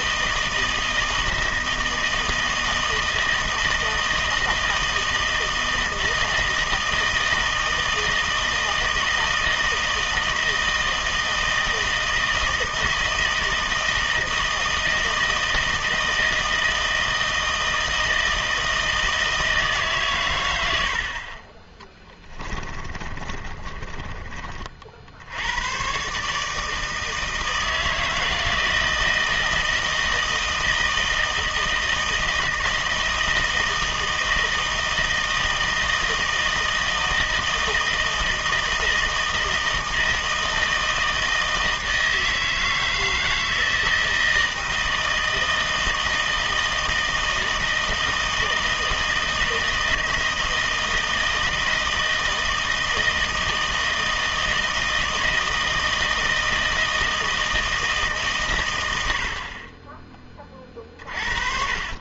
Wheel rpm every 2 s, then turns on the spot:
160, 160, 160, 160, 160, 160, 160, 160, 160, 160, 80, 30, 50, 160, 160, 160, 160, 160, 160, 160, 160, 160, 160, 160, 160, 160, 160, 160, 160, 110, 30.
22-24 60-62